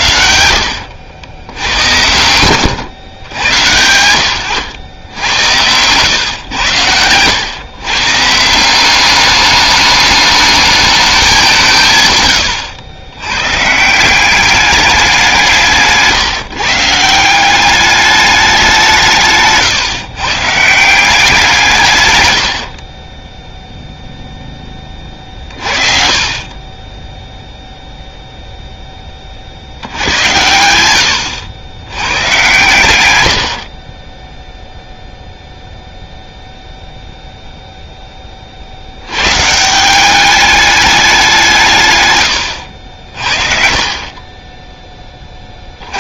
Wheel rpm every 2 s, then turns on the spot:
80, 110, 100, 100, 170, 210, 110, 200, 150, 190, 160, 70, 10, 30, 0, 90, 120, 0, 0, 60, 210, 80, 20.
0-4